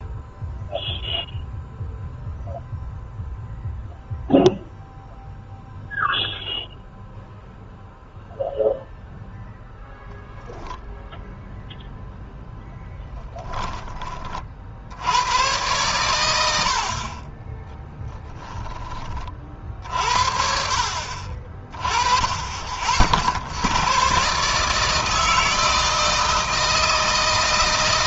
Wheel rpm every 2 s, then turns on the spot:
0, 0, 0, 0, 0, 0, 0, 80, 60, 20, 60, 40, 150, 160.
none